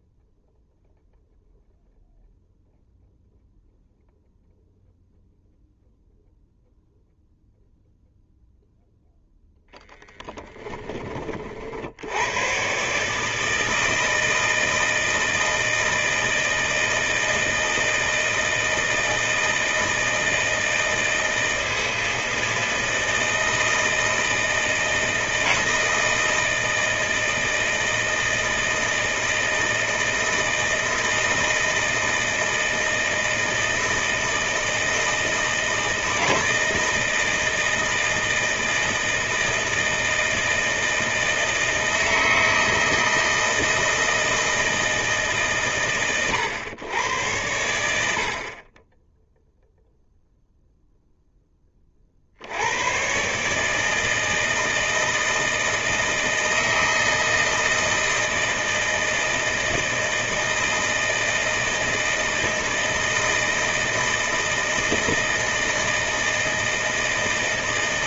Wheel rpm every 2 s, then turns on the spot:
0, 0, 0, 0, 0, 30, 140, 160, 160, 160, 160, 160, 160, 160, 160, 160, 160, 160, 160, 160, 160, 160, 160, 100, 10, 0, 120, 160, 160, 160, 160, 160, 160, 160.
none